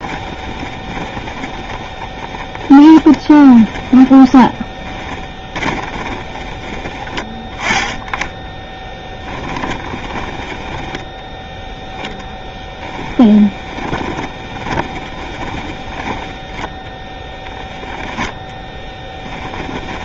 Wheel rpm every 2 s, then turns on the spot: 20, 20, 20, 20, 20, 10, 10, 20, 10, 10.
0-6 8-16